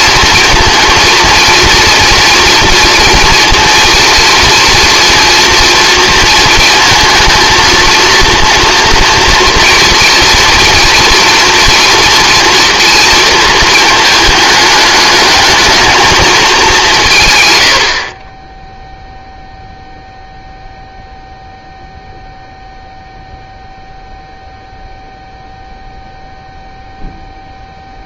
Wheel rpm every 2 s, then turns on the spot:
230, 230, 230, 230, 230, 230, 230, 210, 200, 10, 0, 0, 0, 0.
none